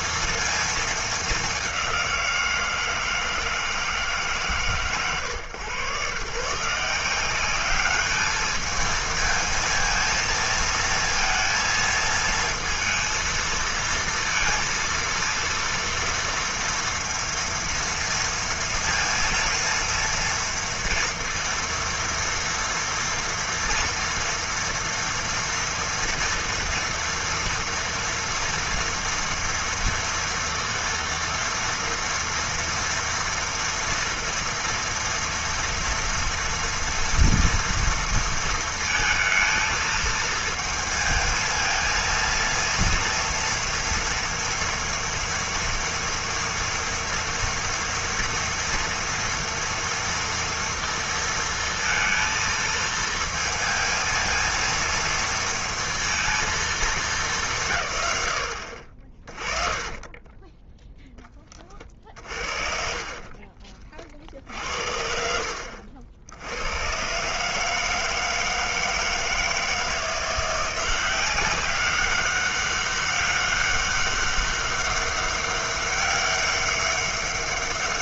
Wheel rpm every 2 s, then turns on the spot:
220, 170, 120, 160, 220, 230, 230, 230, 230, 230, 230, 230, 230, 230, 230, 230, 230, 230, 230, 220, 220, 230, 230, 230, 230, 230, 220, 230, 220, 70, 10, 50, 60, 90, 160, 170, 200, 200, 200.
60-64